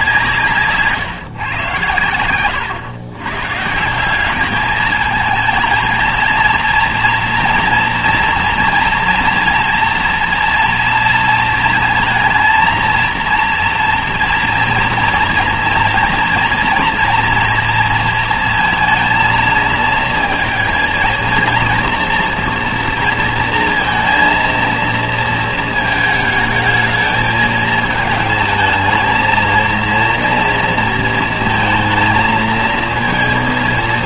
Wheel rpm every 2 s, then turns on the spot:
140, 110, 220, 230, 240, 230, 230, 240, 230, 230, 230, 230, 220, 220, 220, 230, 230.
none